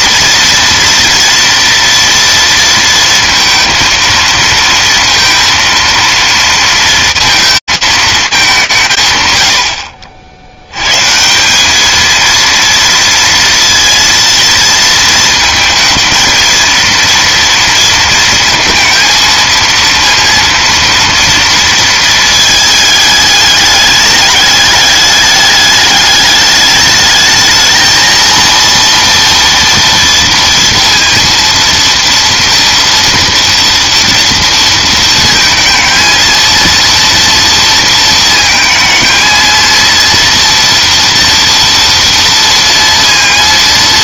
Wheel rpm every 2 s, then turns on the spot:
230, 230, 230, 230, 210, 80, 230, 230, 220, 230, 230, 220, 210, 210, 230, 230, 230, 230, 230, 230, 230, 230.
none